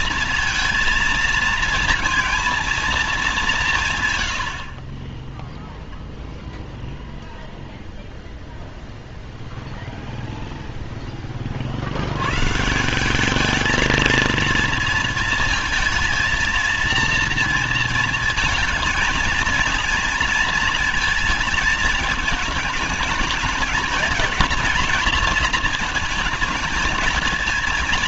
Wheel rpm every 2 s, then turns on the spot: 230, 230, 70, 0, 0, 0, 140, 230, 230, 220, 230, 220, 230, 220.
none